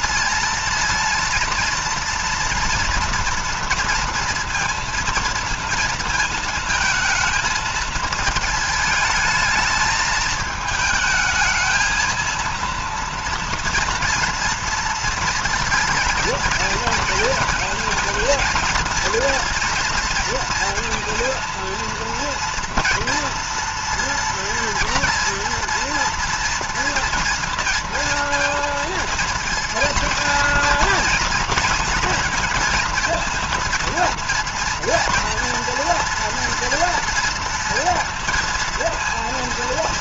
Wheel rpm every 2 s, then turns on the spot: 230, 230, 230, 220, 220, 220, 230, 230, 230, 230, 230, 230, 230, 230, 230, 240, 230, 230, 230, 230.
none